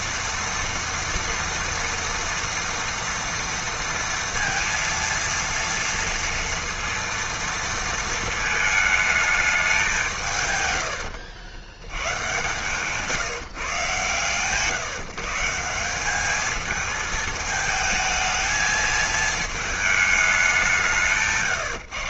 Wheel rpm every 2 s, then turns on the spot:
230, 240, 230, 230, 220, 130, 130, 140, 210, 220, 190.
12-14